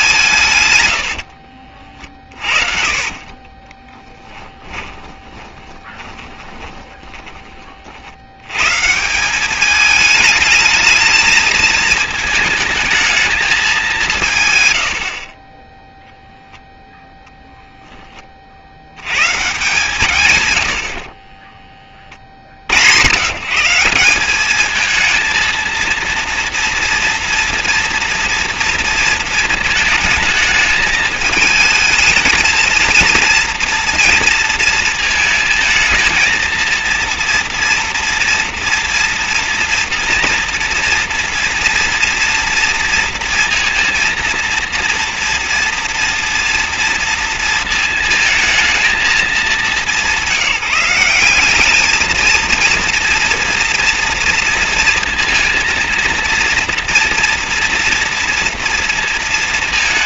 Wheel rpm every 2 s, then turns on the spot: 120, 40, 20, 20, 120, 220, 220, 130, 0, 60, 90, 50, 200, 230, 230, 220, 220, 230, 230, 230, 230, 230, 230, 230, 220, 180, 230, 230, 230, 230.
0-8